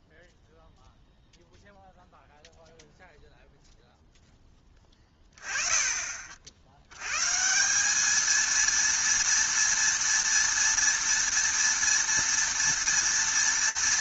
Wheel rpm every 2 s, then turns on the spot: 0, 0, 20, 190, 230, 240, 220.
none